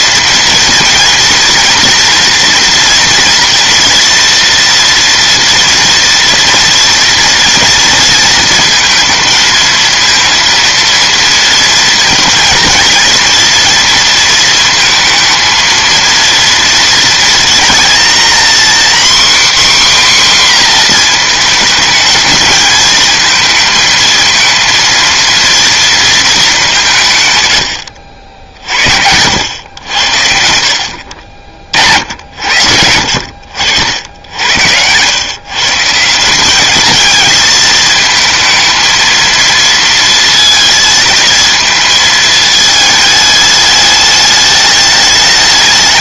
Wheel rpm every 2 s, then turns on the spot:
230, 240, 230, 230, 230, 230, 230, 230, 230, 260, 230, 220, 230, 140, 80, 50, 70, 100, 220, 230, 230, 220, 210.
none